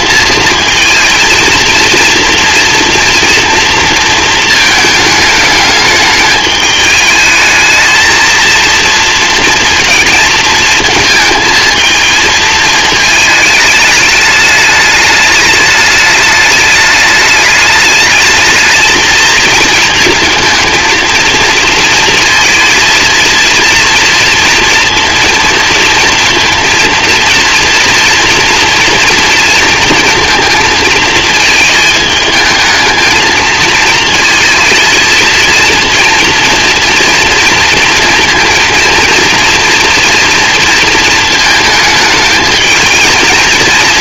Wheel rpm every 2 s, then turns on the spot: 230, 230, 220, 210, 230, 220, 220, 210, 210, 220, 230, 230, 230, 230, 240, 230, 220, 220, 230, 230, 230, 220.
none